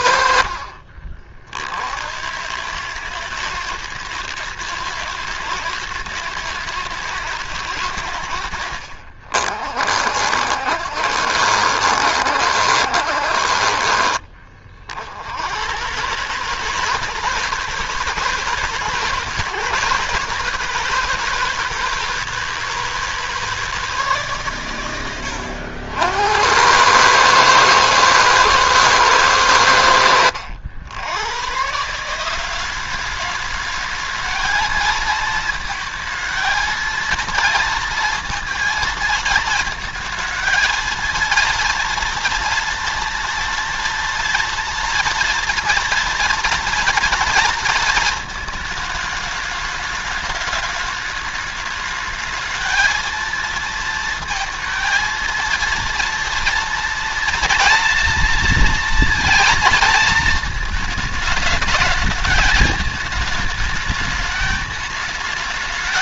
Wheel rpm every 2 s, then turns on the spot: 40, 100, 110, 110, 80, 60, 70, 70, 160, 160, 160, 160, 100, 100, 110, 90, 200, 220, 230, 230, 230, 230, 230, 230, 220, 210, 220, 230, 230, 230, 220, 220, 210.
none